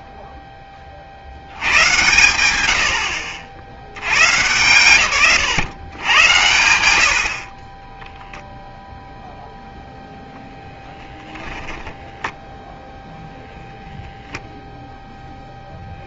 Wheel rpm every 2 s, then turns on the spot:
50, 50, 130, 70, 0, 20, 10, 10.
10-12